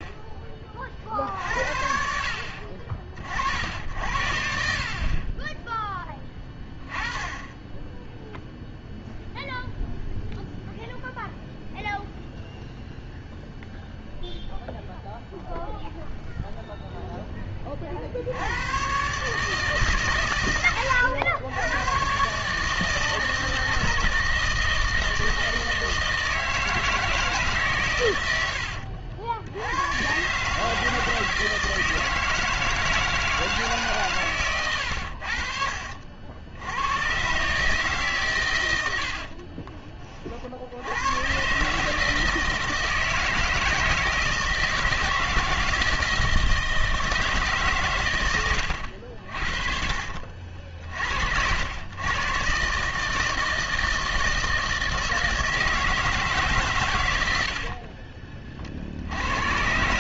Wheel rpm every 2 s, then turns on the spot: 40, 50, 50, 10, 0, 0, 0, 0, 0, 120, 100, 160, 160, 160, 70, 160, 160, 90, 110, 70, 90, 160, 170, 160, 70, 60, 150, 160, 110, 60.
28-30 34-36